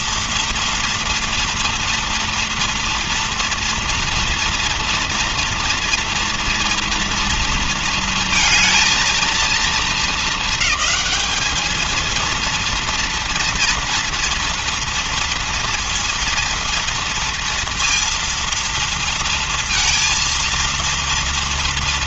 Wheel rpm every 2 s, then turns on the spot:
230, 230, 230, 230, 230, 220, 230, 230, 230, 230, 230.
none